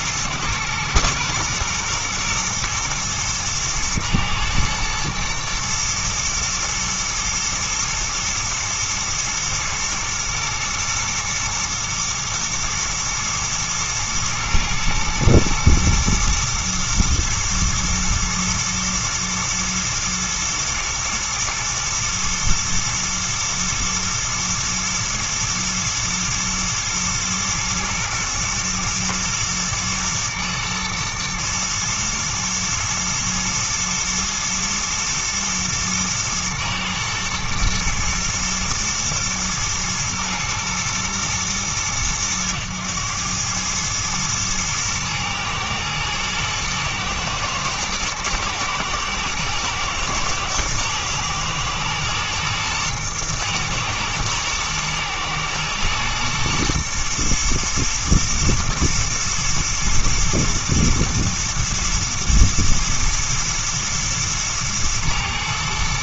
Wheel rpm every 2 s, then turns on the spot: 120, 120, 110, 110, 110, 120, 110, 110, 110, 110, 110, 120, 110, 110, 120, 110, 110, 120, 110, 120, 120, 110, 110, 110, 110, 110, 120, 110, 120, 110, 120, 110, 110.
none